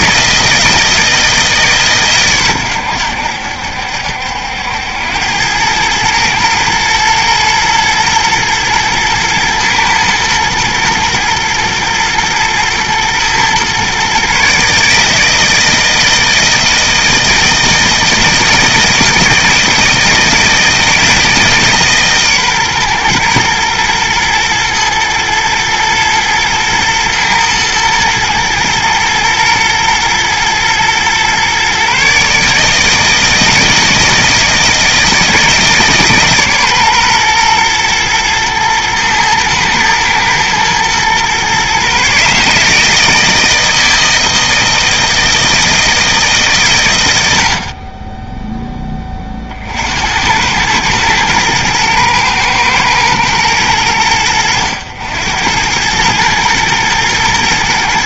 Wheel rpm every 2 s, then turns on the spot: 160, 100, 80, 110, 110, 110, 110, 150, 160, 160, 160, 130, 110, 110, 120, 120, 160, 160, 130, 110, 110, 150, 160, 120, 10, 100, 110, 90, 110.
none